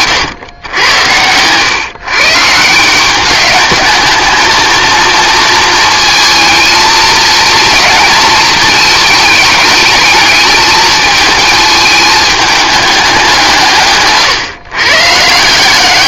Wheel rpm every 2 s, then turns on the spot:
110, 160, 220, 230, 220, 220, 210, 130.
none